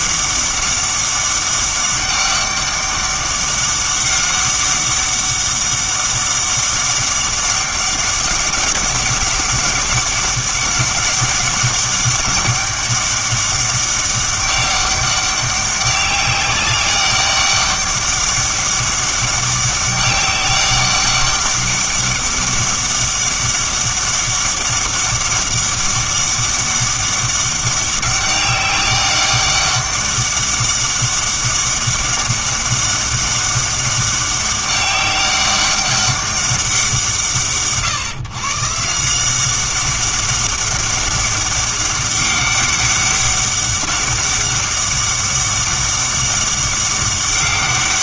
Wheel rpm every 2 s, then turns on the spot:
200, 200, 200, 200, 190, 200, 200, 200, 190, 200, 200, 200, 200, 200, 200, 200, 200, 200, 180, 150, 200, 200, 200, 200.
none